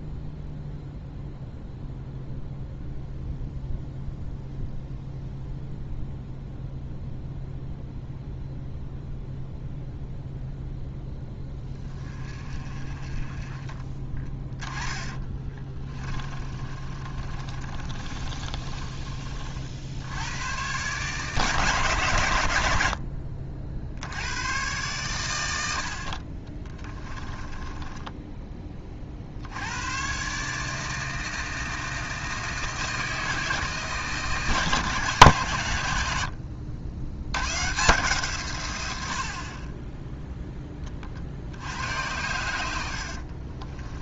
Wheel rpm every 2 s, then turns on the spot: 0, 0, 0, 0, 0, 0, 30, 20, 30, 30, 120, 80, 110, 20, 30, 150, 160, 150, 80, 100, 20, 80.
14-20 22-24 26-28 42-44